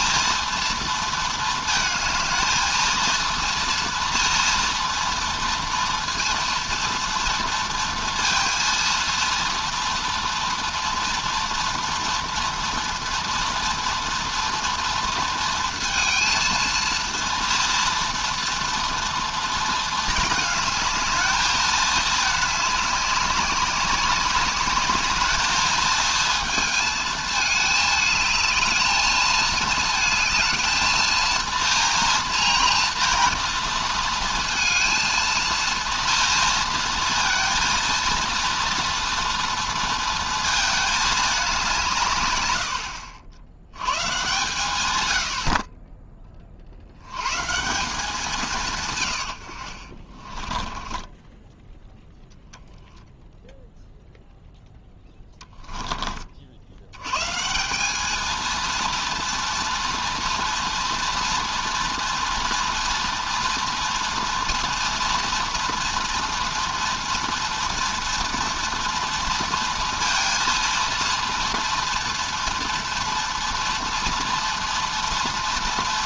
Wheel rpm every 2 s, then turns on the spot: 230, 230, 230, 230, 230, 230, 230, 230, 230, 230, 220, 200, 210, 230, 220, 220, 230, 230, 230, 230, 220, 90, 120, 50, 150, 20, 0, 10, 70, 230, 230, 230, 230, 240, 230, 230, 240, 230.
50-52